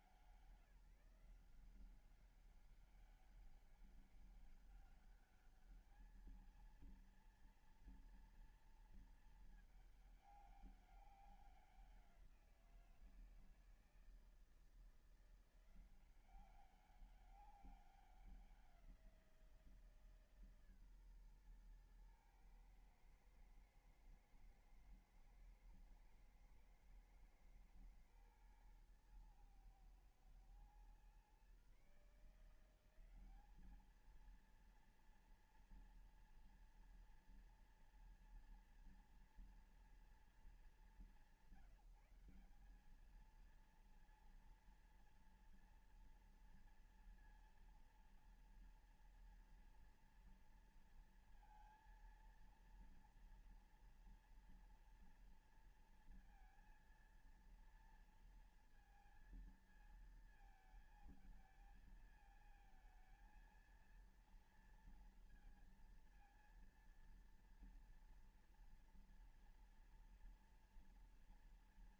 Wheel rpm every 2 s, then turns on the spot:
160, 190, 200, 220, 230, 200, 170, 160, 190, 180, 140, 110, 110, 110, 110, 120, 170, 230, 230, 230, 190, 200, 230, 240, 230, 230, 230, 230, 230, 230, 220, 220, 230, 230, 230, 240.
none